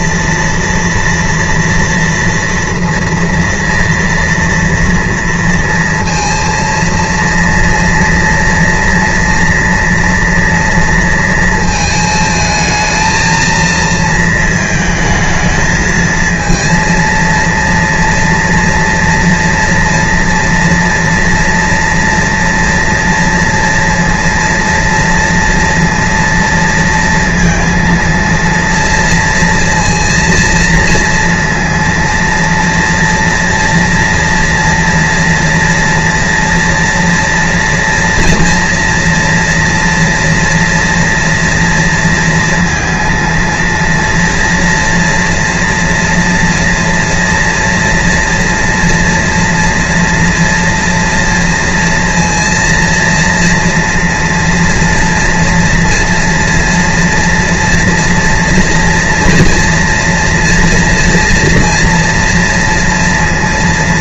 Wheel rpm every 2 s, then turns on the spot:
230, 230, 230, 230, 230, 230, 220, 220, 230, 230, 230, 230, 230, 230, 230, 230, 230, 230, 230, 240, 230, 230, 240, 230, 230, 230, 230, 230, 230, 230, 230, 230.
none